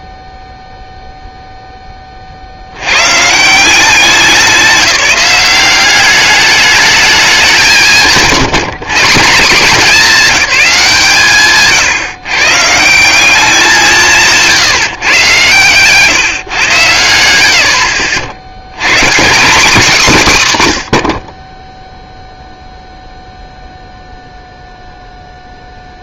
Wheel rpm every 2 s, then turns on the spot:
0, 50, 190, 210, 170, 200, 140, 160, 140, 100, 180, 0, 0.
none